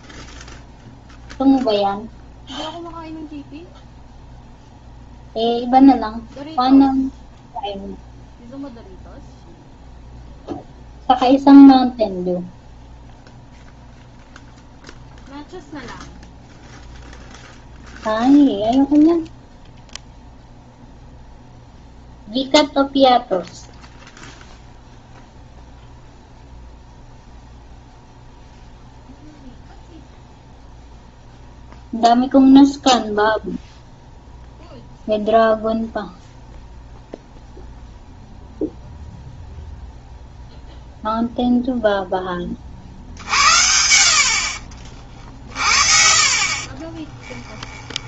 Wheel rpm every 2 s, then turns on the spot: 0, 0, 0, 0, 0, 0, 0, 0, 0, 0, 0, 0, 0, 0, 0, 0, 0, 0, 0, 0, 0, 50, 40, 30.
46-48